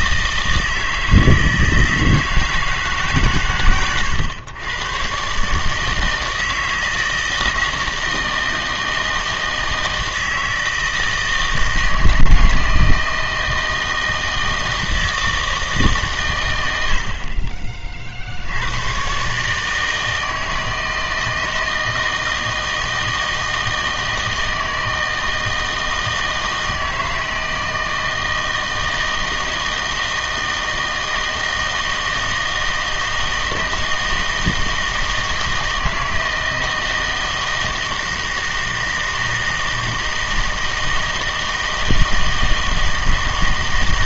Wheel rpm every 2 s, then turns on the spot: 160, 160, 110, 160, 160, 160, 160, 160, 100, 90, 160, 160, 160, 160, 160, 160, 160, 160, 160, 160, 160, 160.
none